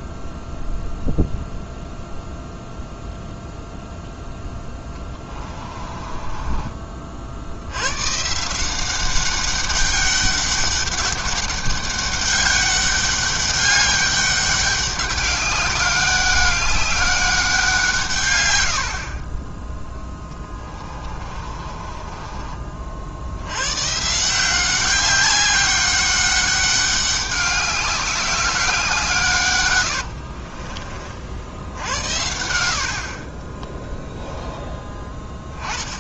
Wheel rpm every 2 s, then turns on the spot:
0, 0, 10, 30, 180, 200, 200, 200, 200, 70, 20, 40, 190, 200, 180, 40, 70, 10.
4-6 20-22 30-32